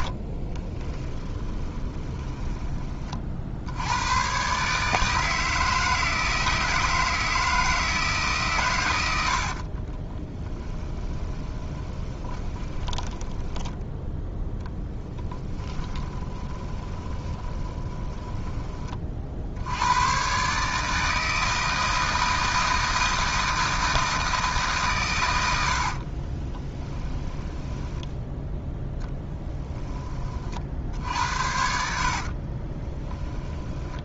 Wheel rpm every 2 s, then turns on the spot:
10, 30, 150, 160, 100, 10, 20, 0, 20, 20, 140, 160, 150, 20, 0, 50, 30.
0-2 8-14 16-18 26-28 32-34